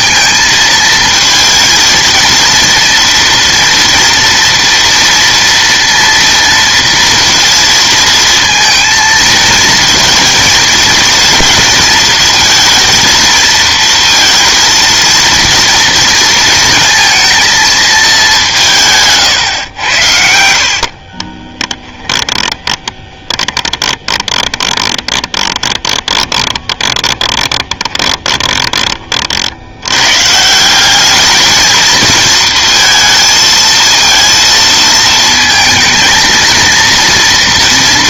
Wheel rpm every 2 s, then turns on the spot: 230, 230, 230, 230, 230, 230, 230, 230, 230, 180, 60, 10, 20, 20, 20, 170, 230, 220, 230.
20-28